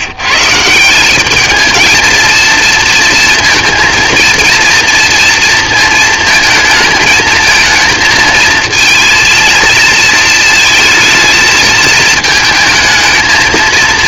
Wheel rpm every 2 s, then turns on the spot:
200, 230, 230, 230, 230, 220, 220.
none